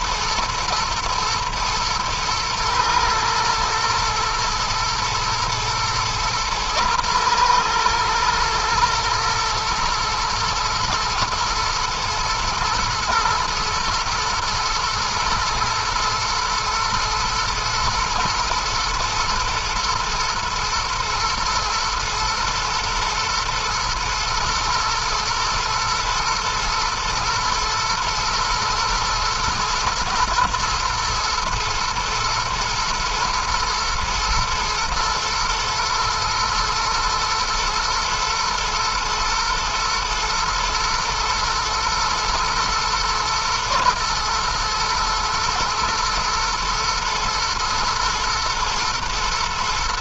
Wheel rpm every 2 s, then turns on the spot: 120, 120, 120, 120, 120, 120, 120, 110, 110, 110, 110, 110, 110, 110, 110, 110, 120, 120, 110, 110, 110, 110, 110, 110, 120.
none